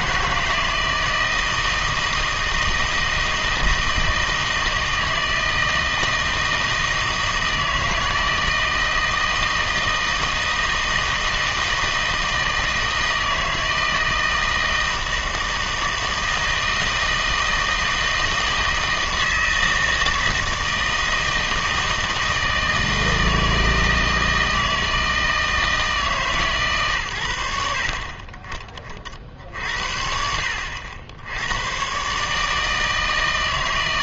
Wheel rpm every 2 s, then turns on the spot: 160, 160, 160, 160, 160, 160, 160, 160, 160, 160, 160, 160, 160, 120, 50, 70, 160.
none